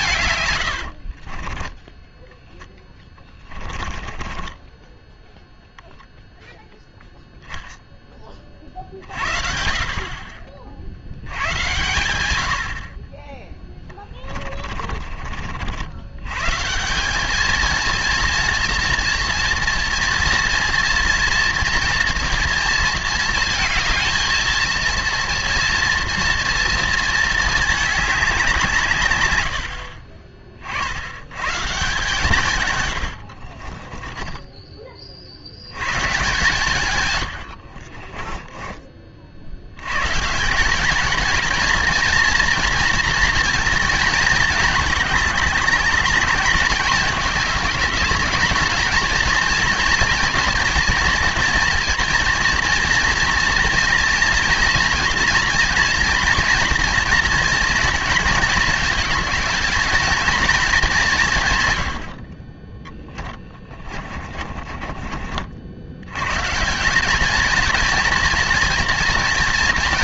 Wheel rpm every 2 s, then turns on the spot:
110, 10, 20, 0, 40, 50, 60, 30, 150, 240, 230, 230, 230, 230, 160, 40, 130, 20, 150, 20, 190, 240, 210, 210, 220, 230, 230, 230, 240, 230, 210, 20, 30, 170, 230.
2-6 14-16 34-36 64-66